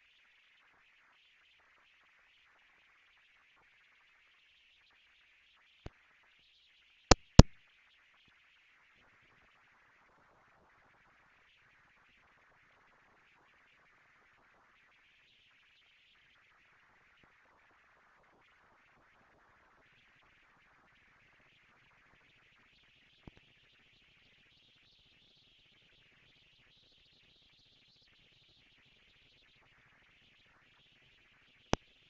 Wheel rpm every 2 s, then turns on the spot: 130, 220, 230, 230, 220, 230, 230, 220, 210, 230, 230, 230, 240, 230, 230, 230.
none